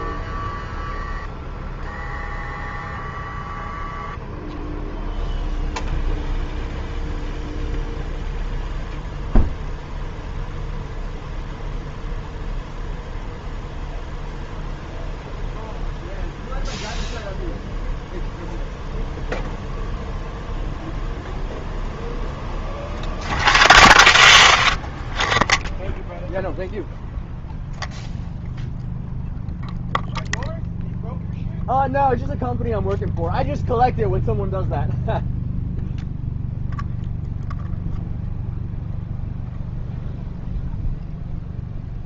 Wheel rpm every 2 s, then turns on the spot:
290, 290, 40, 0, 0, 0, 0, 0, 0, 0, 0, 0, 0, 0, 0, 0, 0, 0, 0, 0, 0.
none